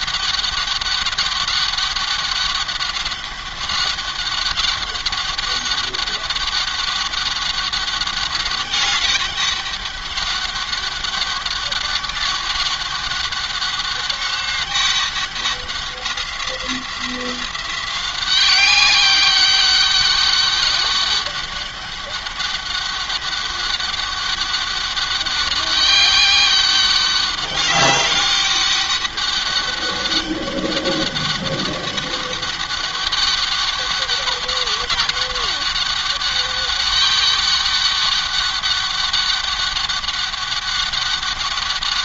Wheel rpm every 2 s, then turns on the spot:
200, 200, 200, 200, 200, 200, 200, 200, 180, 190, 200, 200, 200, 200, 200, 200, 200, 200, 200, 200, 200.
none